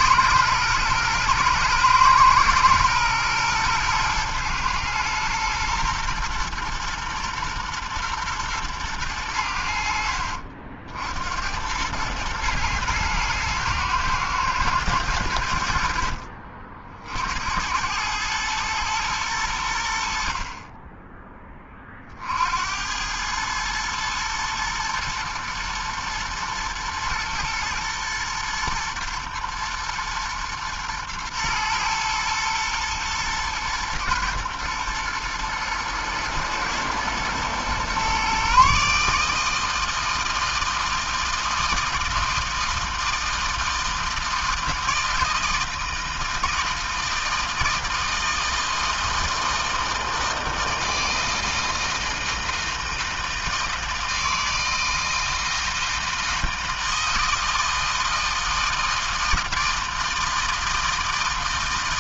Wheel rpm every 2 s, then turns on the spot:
120, 120, 120, 120, 100, 70, 110, 100, 60, 110, 10, 100, 120, 120, 120, 110, 110, 110, 110, 150, 160, 160, 160, 160, 160, 160, 160, 160, 160, 160, 160.
none